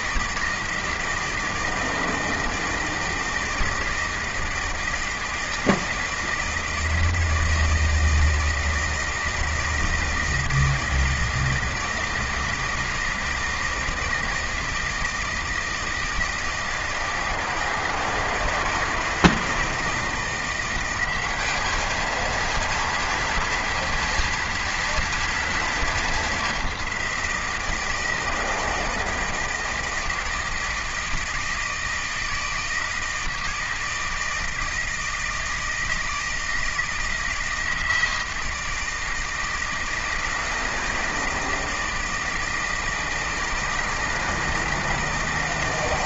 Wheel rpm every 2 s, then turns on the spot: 160, 160, 160, 160, 160, 160, 160, 160, 160, 160, 180, 230, 230, 200, 160, 160, 160, 160, 160, 160, 160, 160, 160.
none